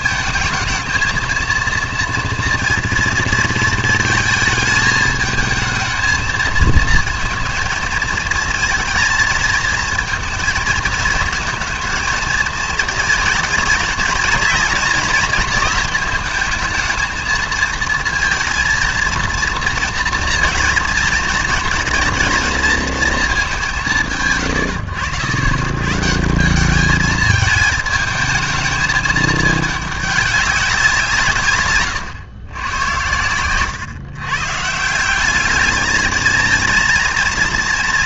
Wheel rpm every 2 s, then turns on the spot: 220, 230, 220, 220, 230, 220, 220, 230, 220, 230, 230, 230, 120, 190, 220, 190, 110, 140, 220.
none